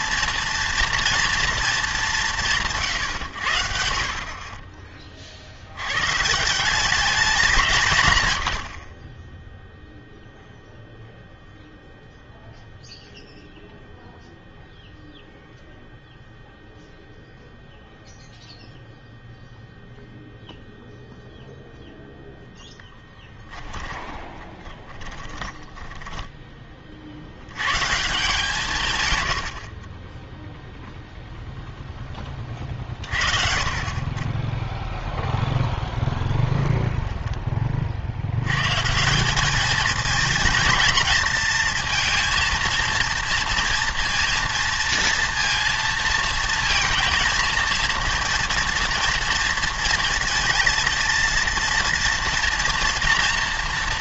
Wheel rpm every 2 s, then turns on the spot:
240, 160, 30, 180, 80, 0, 0, 0, 0, 0, 0, 0, 20, 30, 150, 0, 30, 10, 20, 120, 230, 230, 230, 230, 230, 230, 230.
24-26